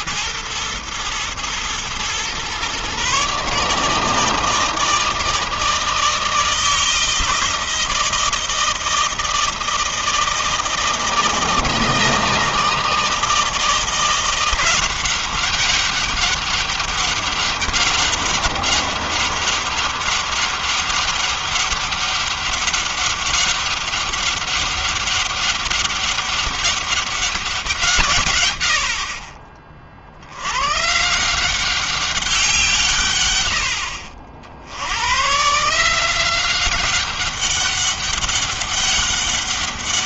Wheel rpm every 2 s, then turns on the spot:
110, 120, 160, 160, 160, 160, 160, 180, 200, 200, 200, 200, 200, 200, 120, 90, 180, 60, 180, 200.
none